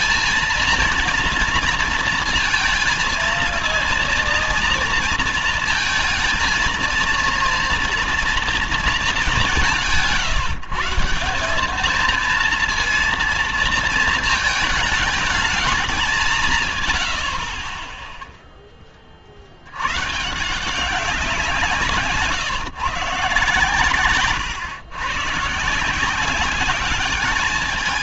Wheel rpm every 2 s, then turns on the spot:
230, 230, 230, 230, 230, 160, 230, 220, 140, 10, 160, 150, 120, 190.
none